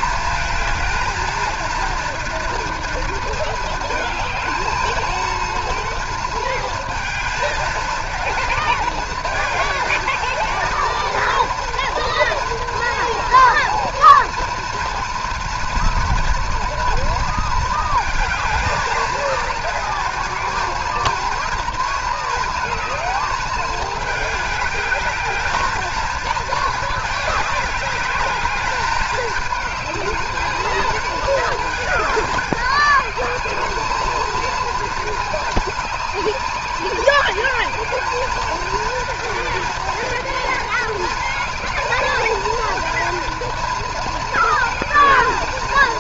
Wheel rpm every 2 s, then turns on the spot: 220, 230, 220, 230, 230, 230, 230, 230, 230, 220, 230, 220, 210, 220, 210, 220, 210, 220, 190, 220, 230, 230, 230.
none